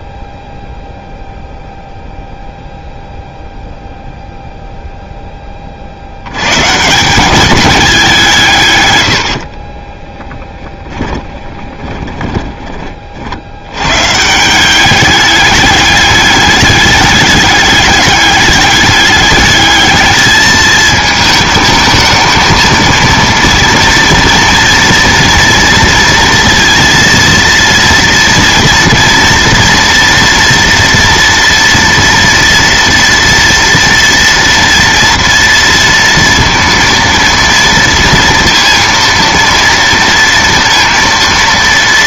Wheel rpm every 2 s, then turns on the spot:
0, 0, 0, 150, 110, 10, 30, 200, 210, 210, 220, 230, 240, 230, 230, 230, 230, 230, 230, 230, 230.
8-12